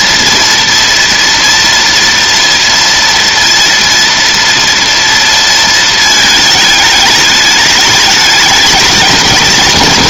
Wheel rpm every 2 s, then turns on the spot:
230, 230, 230, 210, 210.
none